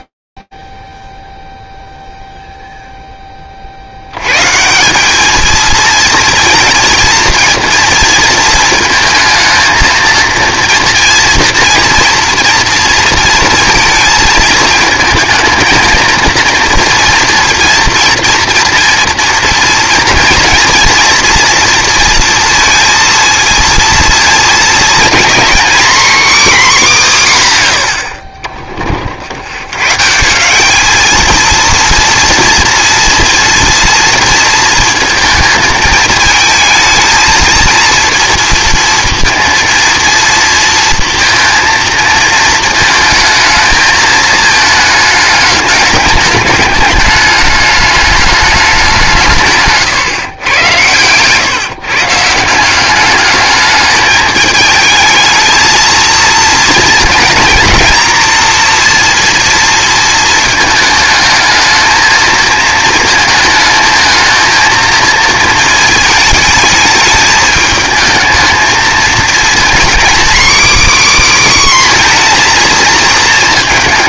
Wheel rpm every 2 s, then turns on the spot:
0, 0, 150, 220, 230, 230, 230, 220, 230, 240, 230, 230, 230, 230, 20, 200, 240, 230, 220, 230, 230, 220, 220, 210, 200, 110, 180, 220, 230, 230, 220, 220, 230, 220, 220, 280, 240.
50-52